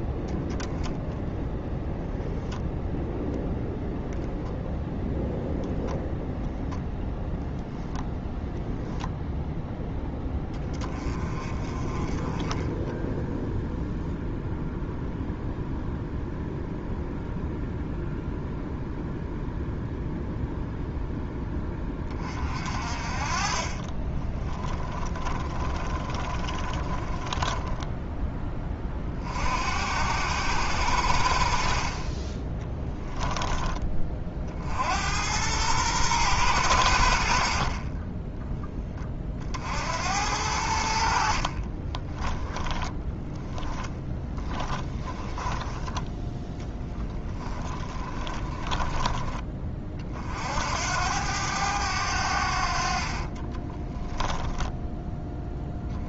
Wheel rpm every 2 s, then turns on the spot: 10, 0, 0, 0, 0, 10, 20, 0, 0, 0, 0, 30, 10, 20, 20, 80, 20, 60, 100, 10, 80, 10, 10, 10, 20, 60, 70, 10.
24-28 32-34 42-46 48-50